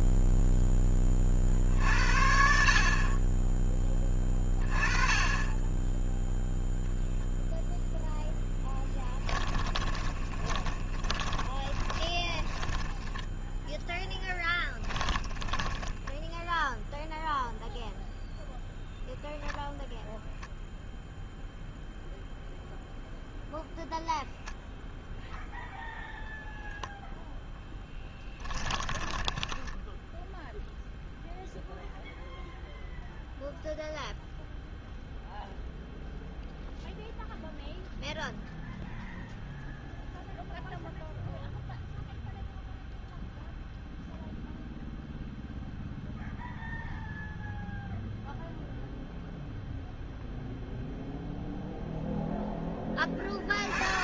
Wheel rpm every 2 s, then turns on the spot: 10, 50, 20, 0, 10, 20, 10, 10, 0, 0, 0, 0, 0, 0, 20, 10, 0, 0, 0, 0, 0, 0, 0, 0, 0, 0, 10.
8-16 28-30